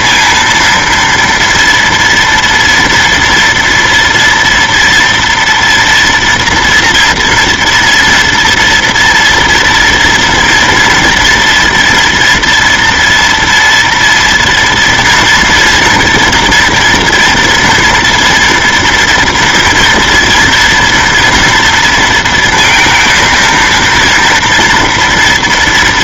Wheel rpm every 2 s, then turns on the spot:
230, 230, 230, 230, 240, 230, 230, 230, 230, 230, 230, 230, 230.
none